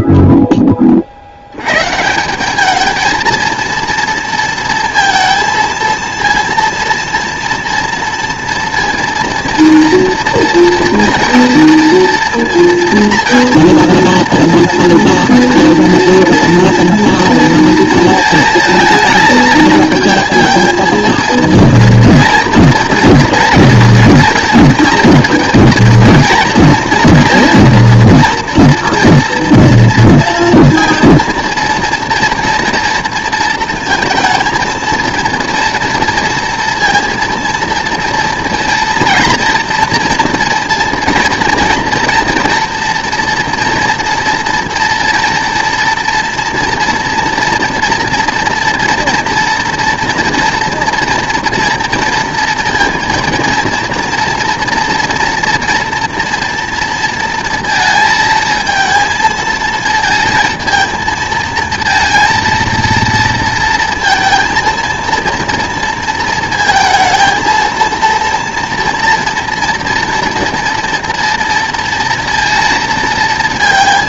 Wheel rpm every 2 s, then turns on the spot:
10, 200, 230, 230, 230, 230, 230, 240, 240, 230, 220, 230, 230, 230, 230, 230, 230, 220, 230, 230, 230, 230, 230, 240, 230, 230, 240, 240, 230, 230, 230, 230, 230, 230, 230, 230, 230.
none